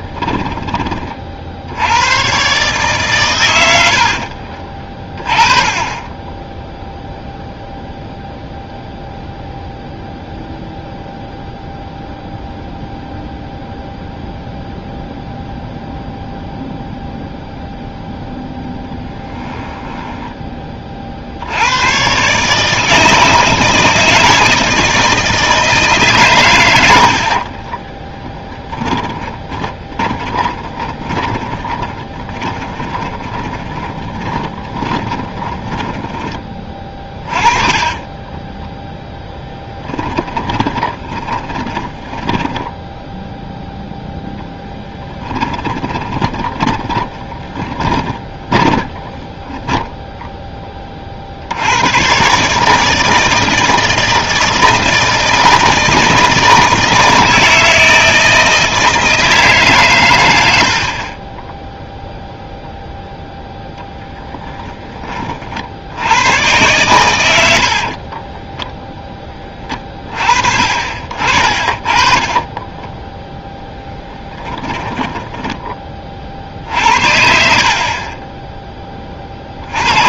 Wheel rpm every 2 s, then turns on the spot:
20, 140, 40, 10, 0, 0, 0, 0, 0, 10, 20, 150, 160, 100, 10, 20, 20, 20, 20, 10, 20, 10, 0, 20, 20, 10, 150, 160, 160, 160, 80, 0, 10, 120, 10, 50, 20, 10, 60, 10.
18-20 28-36 38-44 46-50 72-76